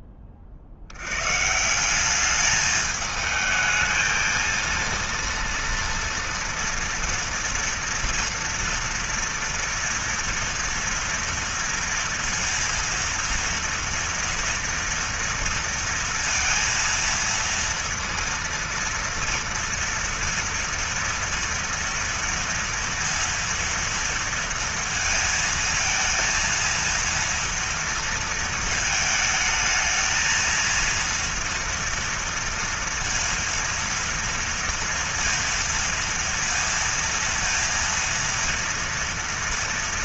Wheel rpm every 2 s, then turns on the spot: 50, 210, 230, 230, 230, 230, 230, 230, 230, 230, 240, 230, 230, 230, 220, 230, 230, 230, 230, 230.
none